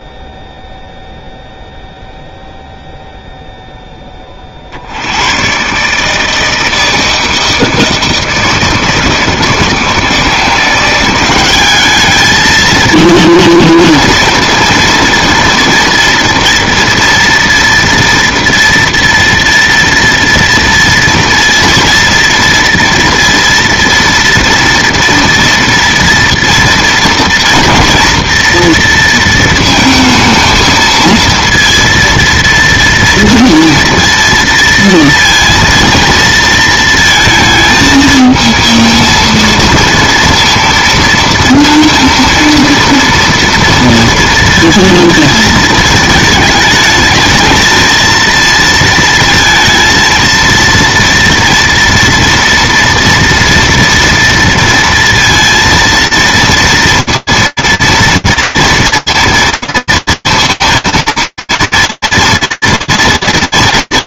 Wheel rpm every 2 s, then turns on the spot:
0, 0, 30, 160, 160, 170, 220, 230, 230, 230, 230, 230, 230, 230, 240, 220, 230, 230, 230, 220, 230, 230, 230, 220, 230, 230, 230, 230, 230, 230, 230, 230.
none